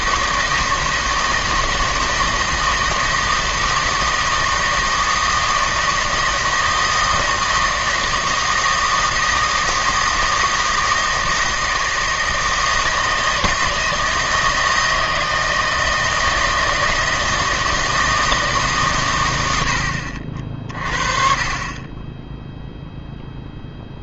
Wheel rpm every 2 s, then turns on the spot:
160, 160, 160, 160, 160, 160, 160, 160, 160, 140, 40, 0.
none